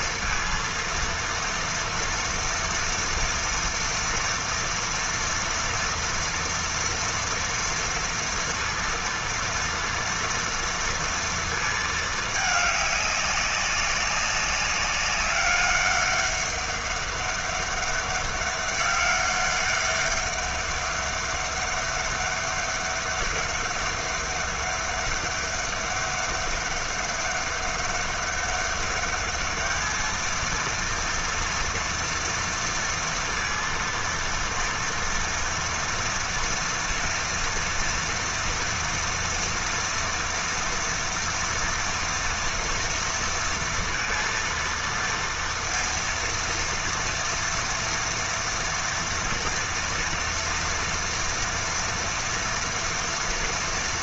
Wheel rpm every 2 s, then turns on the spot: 230, 230, 230, 230, 230, 230, 210, 190, 200, 200, 200, 200, 200, 200, 200, 230, 230, 230, 240, 230, 230, 230, 230, 230, 230, 230, 230.
none